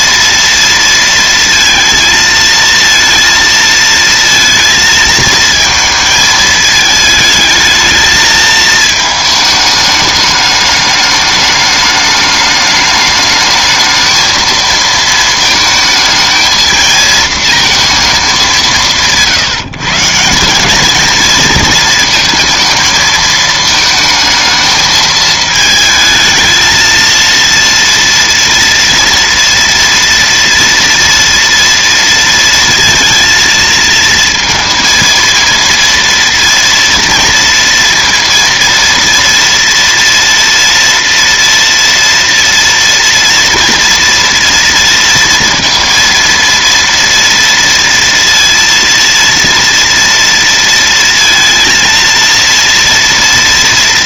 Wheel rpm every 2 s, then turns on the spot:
230, 230, 230, 220, 220, 210, 210, 220, 230, 170, 220, 220, 220, 220, 230, 230, 230, 230, 230, 230, 230, 230, 230, 230, 230, 230, 240.
none